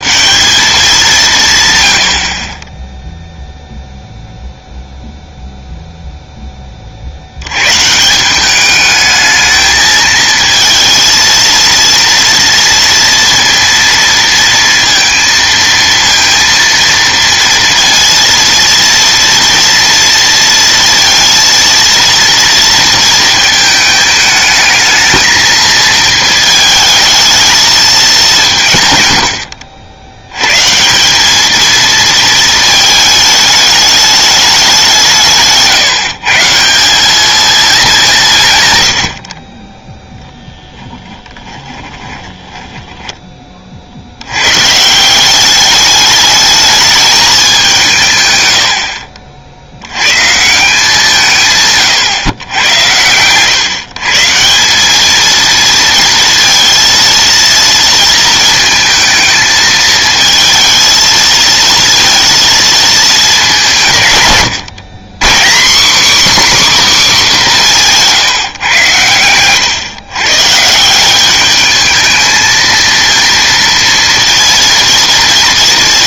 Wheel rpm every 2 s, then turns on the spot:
190, 20, 0, 20, 200, 230, 230, 230, 230, 230, 230, 230, 220, 220, 160, 140, 220, 200, 160, 130, 10, 20, 120, 210, 110, 180, 120, 180, 230, 220, 220, 230, 130, 280, 140, 150, 220, 230.
42-44